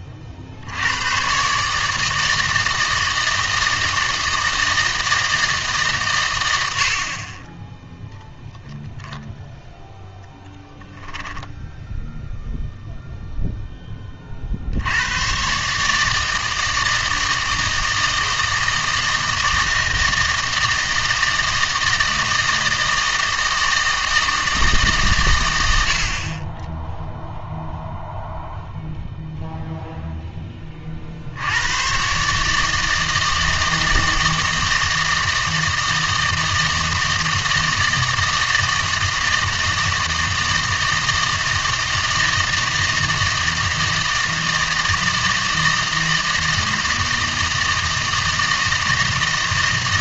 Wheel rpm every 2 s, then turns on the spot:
70, 160, 160, 100, 10, 10, 0, 70, 160, 160, 160, 160, 150, 20, 0, 20, 150, 160, 160, 160, 160, 160, 160, 160, 160.
none